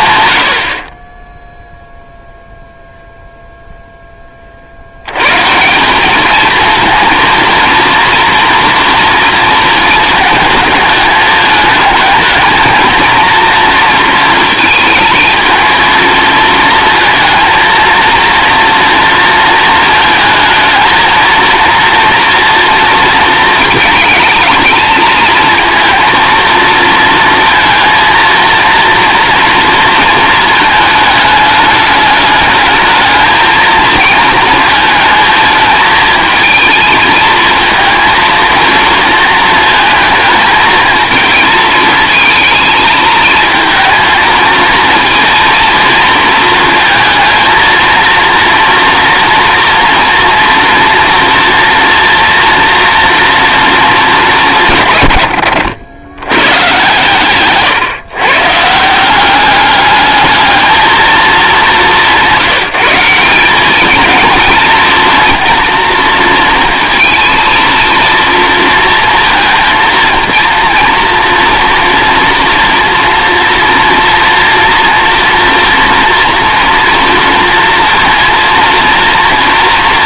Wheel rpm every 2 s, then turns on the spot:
50, 0, 70, 230, 230, 220, 220, 220, 230, 230, 220, 230, 220, 230, 230, 220, 210, 220, 220, 230, 220, 220, 220, 230, 230, 230, 230, 130, 110, 160, 220, 180, 230, 230, 230, 230, 230, 230, 230, 230.
none